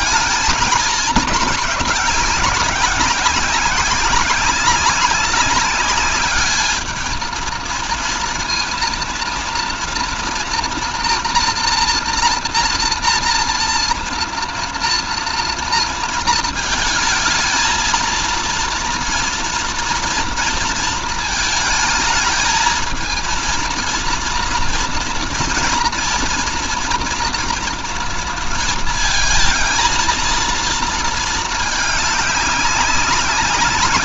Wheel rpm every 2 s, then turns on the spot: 220, 190, 190, 220, 230, 230, 240, 230, 220, 230, 230, 220, 230, 230, 230, 230, 190.
none